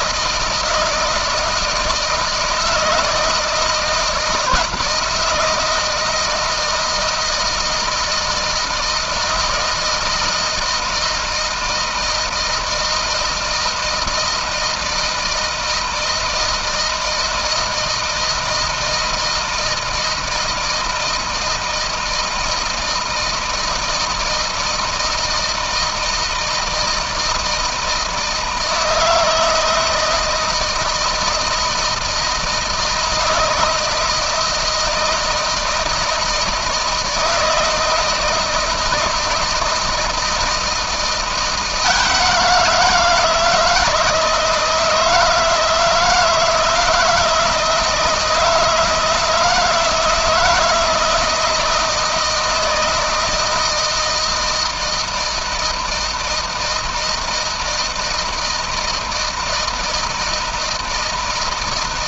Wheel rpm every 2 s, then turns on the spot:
160, 160, 160, 160, 160, 160, 160, 160, 160, 160, 160, 160, 160, 160, 160, 170, 160, 160, 160, 160, 170, 160, 160, 160, 160, 160, 160, 160, 160, 160, 160.
none